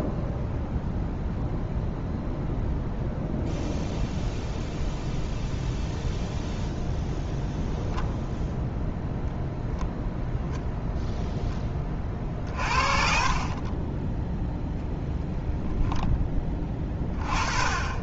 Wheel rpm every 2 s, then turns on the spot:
0, 0, 0, 0, 0, 0, 40, 0, 20.
12-14